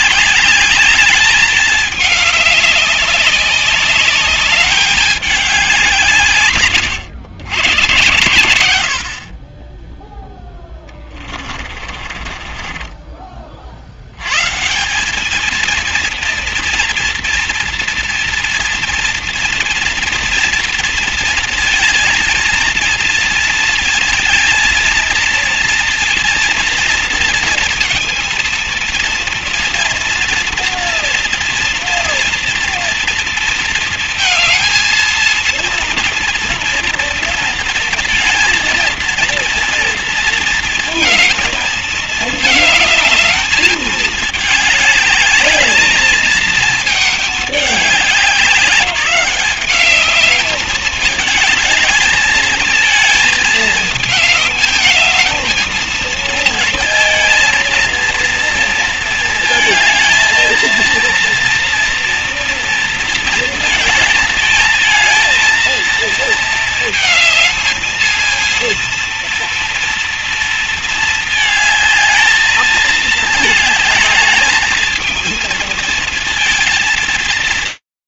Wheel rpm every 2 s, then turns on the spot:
200, 200, 200, 90, 80, 20, 30, 140, 230, 230, 240, 230, 230, 230, 230, 230, 230, 230, 230, 220, 230, 220, 210, 220, 190, 210, 220, 220, 230, 230, 220, 230, 220, 230, 230, 230, 220, 220, 230.
10-14